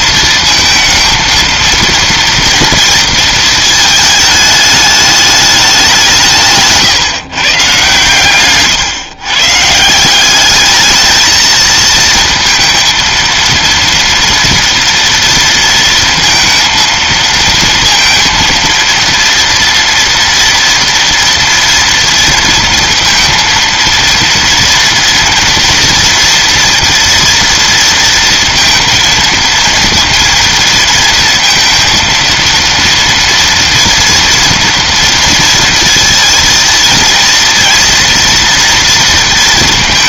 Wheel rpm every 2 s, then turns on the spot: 230, 230, 210, 160, 130, 210, 230, 230, 230, 230, 230, 230, 230, 230, 230, 230, 230, 230, 230, 230.
none